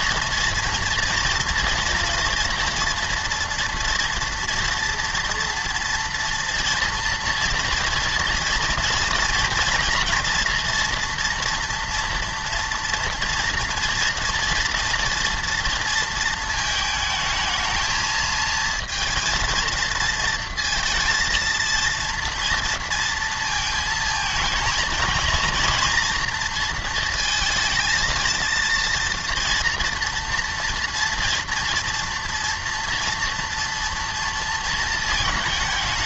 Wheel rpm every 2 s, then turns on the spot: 240, 240, 230, 230, 230, 230, 230, 230, 220, 220, 230, 230, 220, 230, 230, 230, 230, 230.
none